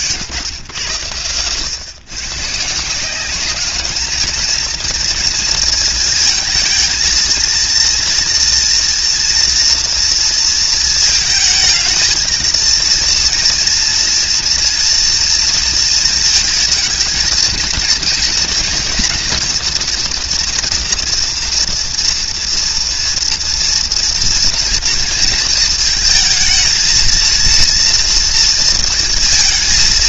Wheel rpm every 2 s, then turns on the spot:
130, 150, 230, 230, 230, 230, 230, 240, 230, 230, 240, 240, 230, 220, 230.
none